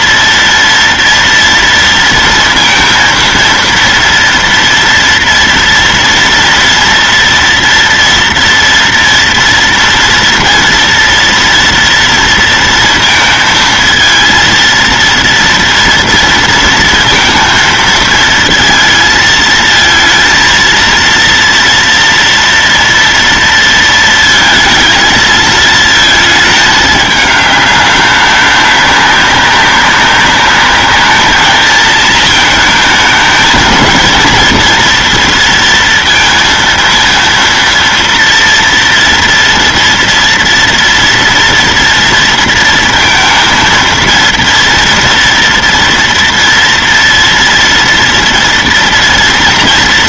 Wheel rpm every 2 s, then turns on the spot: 230, 230, 230, 230, 240, 230, 230, 230, 230, 220, 230, 230, 220, 220, 200, 210, 220, 230, 230, 230, 230, 230, 230, 230, 230.
none